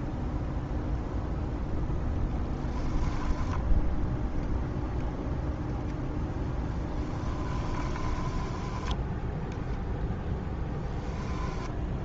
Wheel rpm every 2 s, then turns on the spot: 0, 10, 0, 10, 10, 10.
6-12